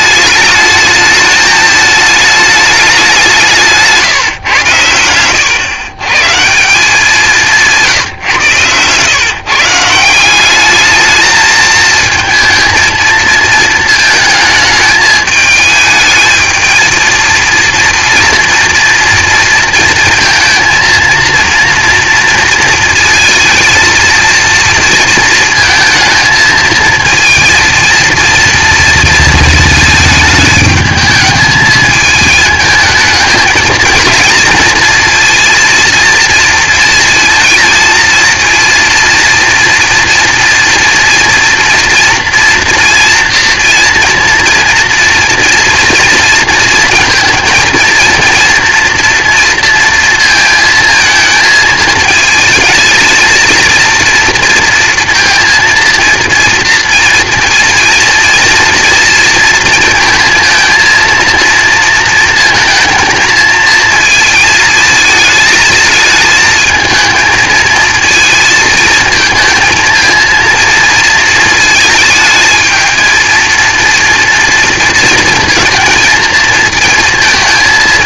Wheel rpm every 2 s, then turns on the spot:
220, 210, 110, 170, 120, 200, 220, 210, 220, 230, 230, 230, 230, 230, 230, 210, 220, 230, 230, 230, 230, 230, 230, 230, 230, 230, 220, 230, 230, 230, 230, 220, 230, 220, 220, 230, 220, 240, 220.
8-10